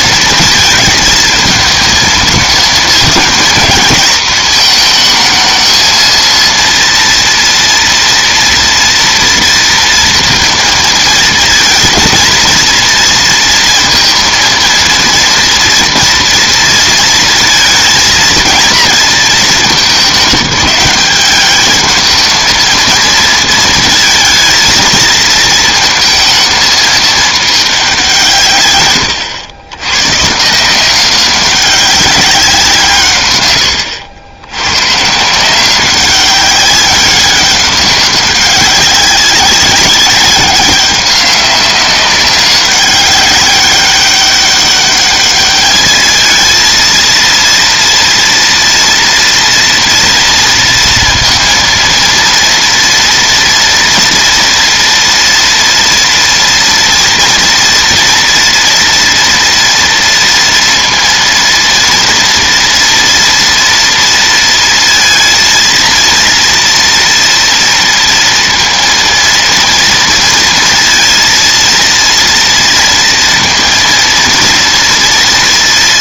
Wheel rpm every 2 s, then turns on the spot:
220, 220, 220, 230, 230, 220, 230, 230, 230, 230, 190, 230, 230, 220, 120, 170, 180, 110, 190, 190, 190, 190, 200, 220, 230, 230, 230, 230, 230, 230, 230, 230, 230, 230, 230, 230, 230, 230.
none